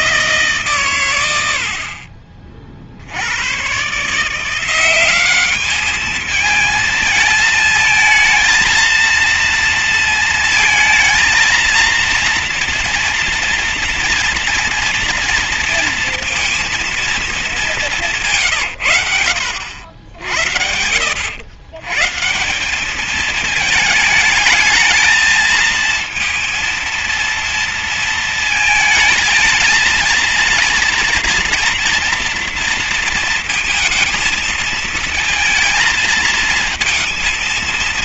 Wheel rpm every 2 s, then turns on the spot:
130, 50, 180, 220, 230, 230, 230, 230, 230, 130, 70, 200, 220, 230, 220, 230, 230, 230, 230.
none